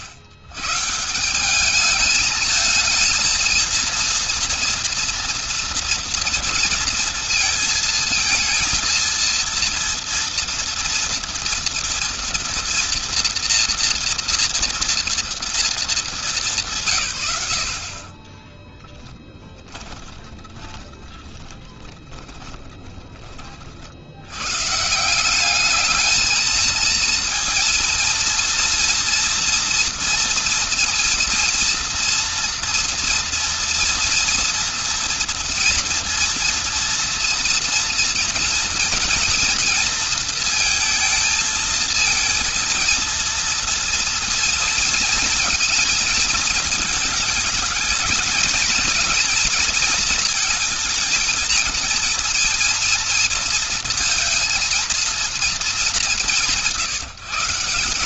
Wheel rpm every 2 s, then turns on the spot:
130, 220, 230, 230, 230, 230, 230, 230, 180, 10, 30, 10, 130, 220, 230, 230, 230, 230, 230, 230, 230, 230, 230, 220, 230, 230, 230, 230, 150.
18-24